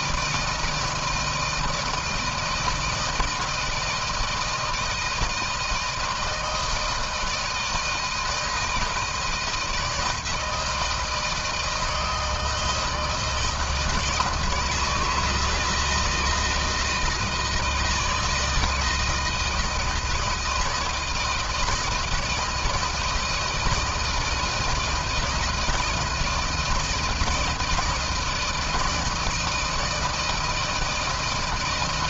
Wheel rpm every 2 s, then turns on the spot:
160, 160, 160, 160, 160, 160, 160, 160, 160, 160, 160, 160, 170, 160, 160, 160.
none